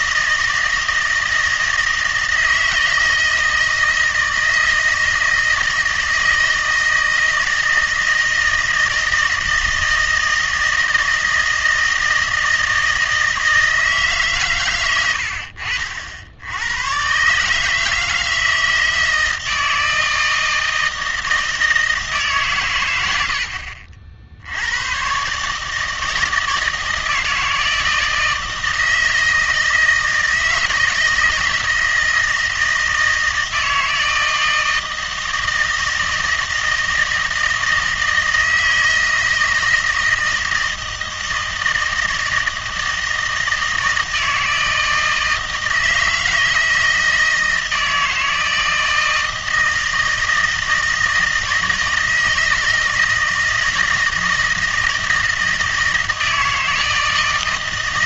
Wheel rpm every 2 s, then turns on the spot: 160, 160, 160, 160, 160, 160, 160, 120, 100, 160, 160, 120, 90, 160, 160, 160, 160, 160, 160, 160, 160, 160, 160, 160, 160, 160, 160, 160, 160.
none